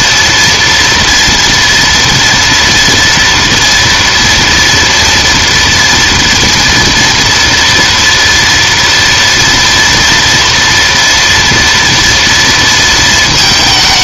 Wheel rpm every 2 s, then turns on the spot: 230, 230, 230, 230, 230, 230, 230.
none